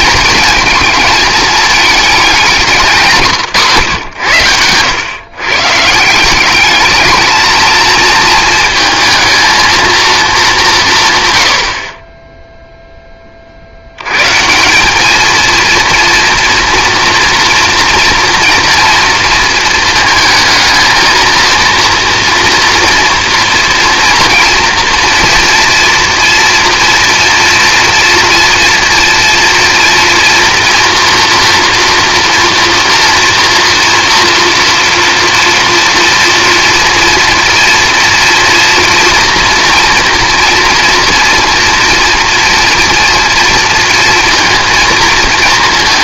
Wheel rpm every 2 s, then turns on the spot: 230, 170, 100, 210, 220, 170, 10, 200, 230, 230, 220, 230, 230, 230, 230, 230, 230, 240, 230, 230, 230, 230, 220.
none